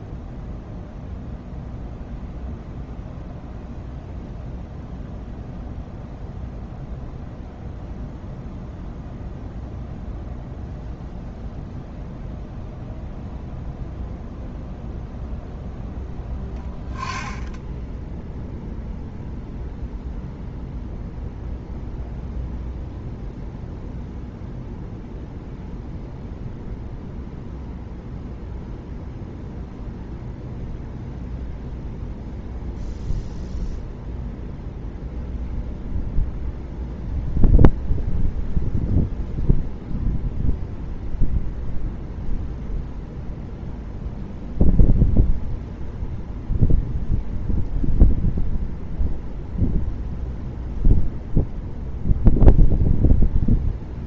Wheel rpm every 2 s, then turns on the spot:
0, 0, 0, 0, 0, 0, 0, 0, 10, 0, 0, 0, 0, 0, 0, 0, 0, 0, 0, 0, 0, 0, 0, 0, 0, 0, 0.
none